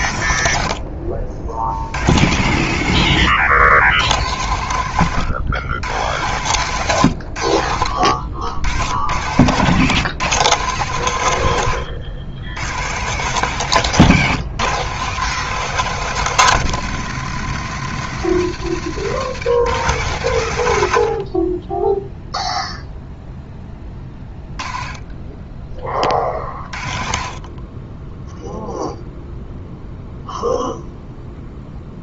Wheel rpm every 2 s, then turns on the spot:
80, 100, 110, 120, 90, 140, 110, 140, 140, 130, 90, 0, 20, 50, 0, 0.
none